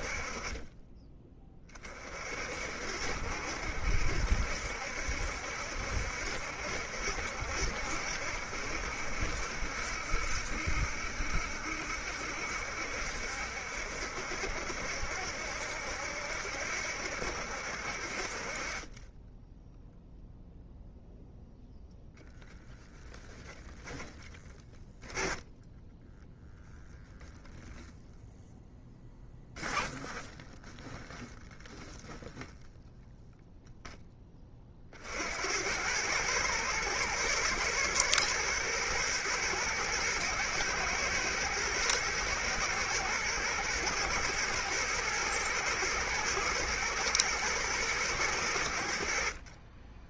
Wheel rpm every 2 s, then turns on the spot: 20, 50, 70, 70, 70, 70, 70, 70, 70, 30, 0, 10, 10, 0, 0, 20, 0, 30, 110, 110, 110, 110, 110, 110, 90.
22-24